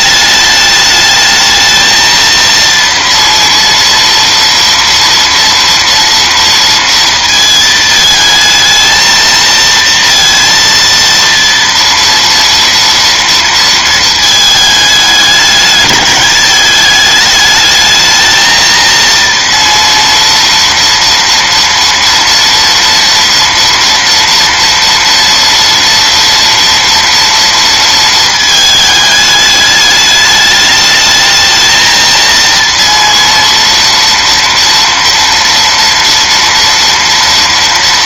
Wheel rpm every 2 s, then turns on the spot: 210, 230, 230, 230, 220, 230, 230, 210, 210, 230, 230, 230, 230, 230, 220, 210, 230, 230, 230.
none